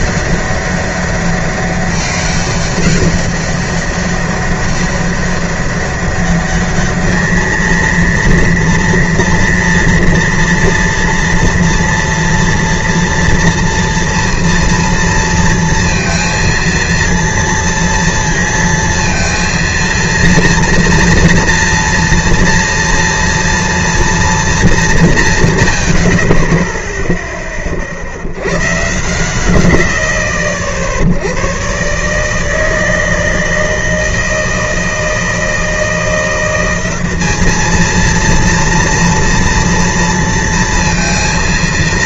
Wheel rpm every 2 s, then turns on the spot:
200, 190, 200, 210, 230, 230, 240, 230, 230, 230, 240, 230, 210, 20, 120, 90, 160, 160, 190, 230, 230.
none